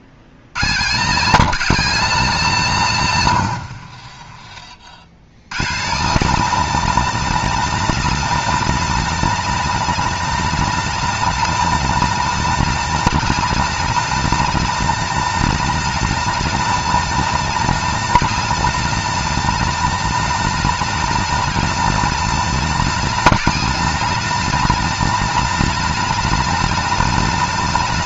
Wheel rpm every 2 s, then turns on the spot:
130, 140, 70, 200, 210, 210, 200, 210, 210, 210, 210, 210, 210, 210.
none